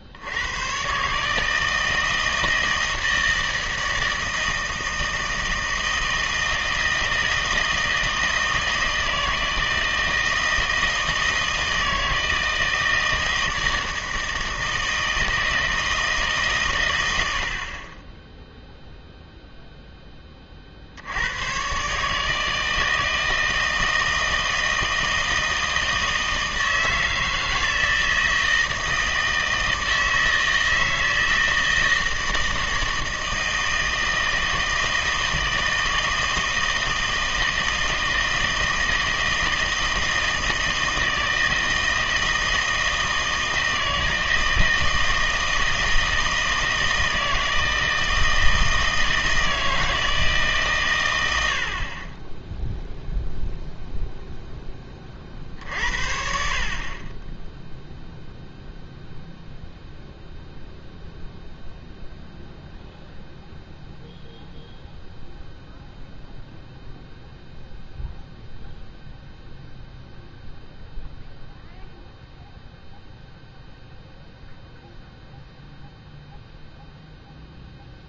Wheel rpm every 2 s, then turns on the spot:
100, 160, 160, 160, 160, 160, 160, 160, 130, 0, 40, 160, 160, 160, 160, 160, 160, 160, 160, 160, 160, 160, 160, 160, 160, 140, 0, 10, 50, 0, 0, 0, 0, 0, 0, 0, 0, 0, 0.
none